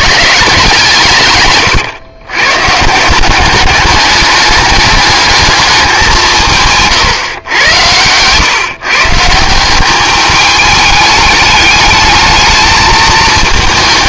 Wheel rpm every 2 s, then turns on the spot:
160, 150, 210, 140, 140, 210, 220.
none